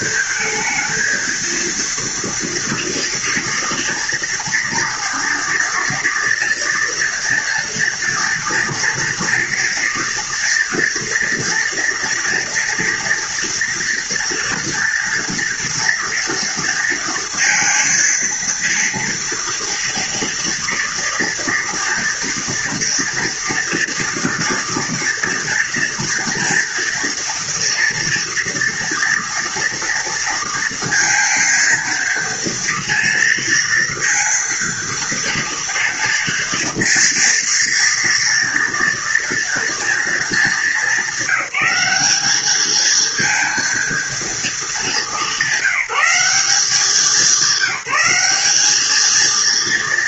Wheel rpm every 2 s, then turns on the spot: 230, 230, 230, 240, 240, 230, 230, 230, 230, 230, 240, 240, 230, 230, 230, 230, 230, 230, 230, 230, 200, 210, 210, 190, 200.
none